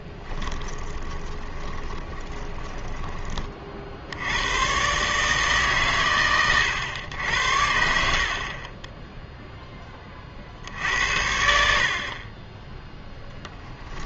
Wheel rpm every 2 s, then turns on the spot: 20, 20, 120, 110, 30, 70, 10.
0-4